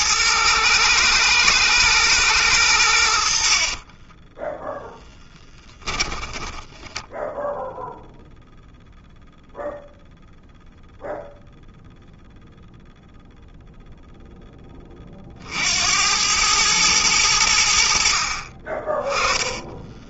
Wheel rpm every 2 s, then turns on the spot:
120, 90, 0, 20, 0, 0, 0, 20, 110, 20.
6-8 18-20